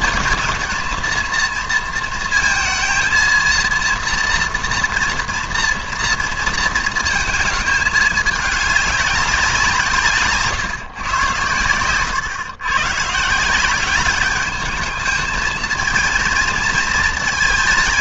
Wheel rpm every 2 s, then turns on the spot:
220, 230, 230, 230, 210, 140, 120, 210, 230.
none